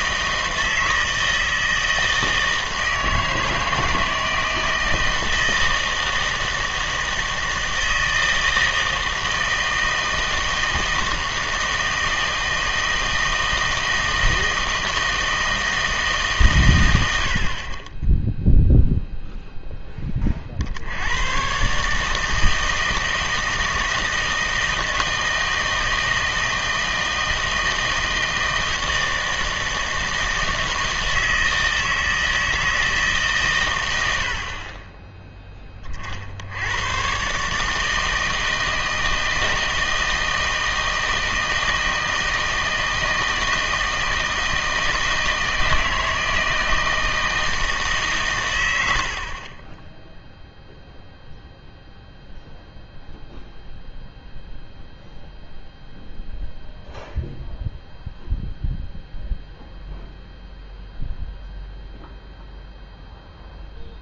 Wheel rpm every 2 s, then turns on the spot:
160, 160, 160, 160, 160, 160, 160, 160, 120, 0, 50, 160, 160, 160, 160, 160, 160, 50, 100, 160, 160, 160, 160, 160, 100, 0, 0, 0, 0, 0, 0, 0.
none